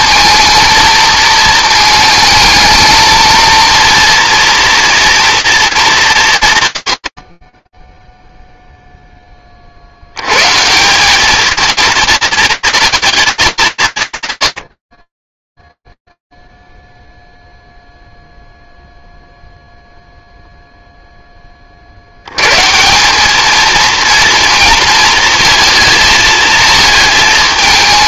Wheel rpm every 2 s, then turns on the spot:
230, 220, 230, 110, 0, 130, 230, 90, 0, 0, 0, 130, 230, 220.
none